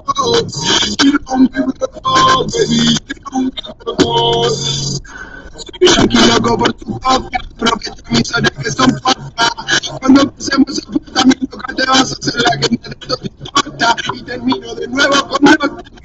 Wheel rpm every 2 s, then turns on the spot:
0, 0, 0, 0, 0, 0, 0, 0.
none